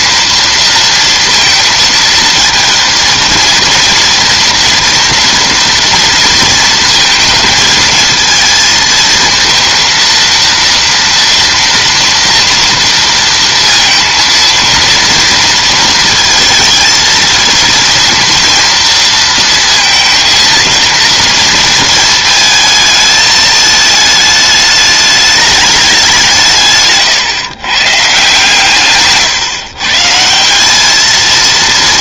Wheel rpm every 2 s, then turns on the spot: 230, 220, 230, 230, 230, 230, 230, 230, 230, 230, 230, 220, 210, 150, 150, 220.
26-30